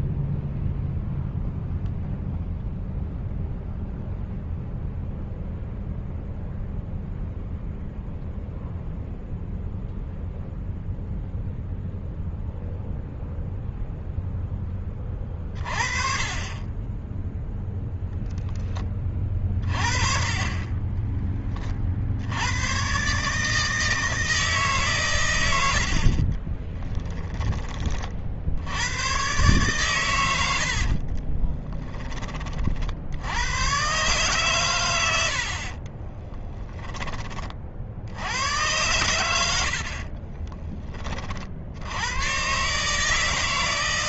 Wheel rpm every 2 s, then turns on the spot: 0, 0, 0, 0, 0, 0, 0, 20, 10, 20, 20, 120, 130, 20, 100, 60, 60, 110, 10, 110, 30, 150.
26-28 30-32